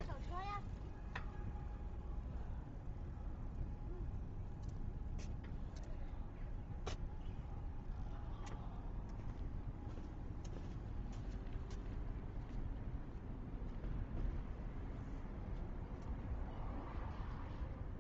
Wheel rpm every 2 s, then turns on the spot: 0, 0, 0, 0, 0, 0, 0, 0, 0.
none